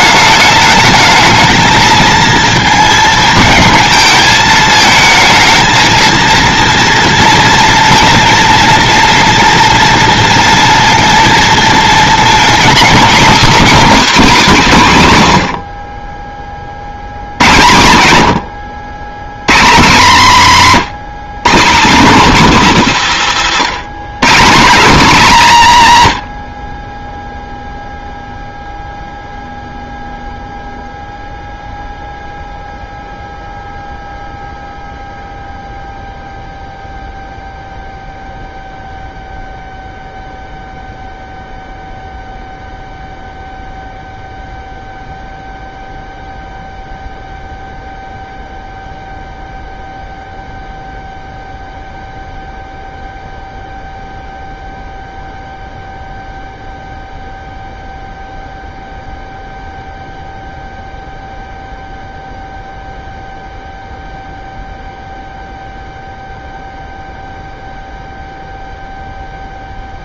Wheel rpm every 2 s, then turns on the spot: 210, 230, 220, 230, 230, 230, 240, 210, 60, 110, 200, 190, 250, 40, 0, 0, 0, 0, 0, 0, 0, 0, 0, 0, 0, 0, 0, 0, 0, 0, 0, 0, 0, 0, 0.
none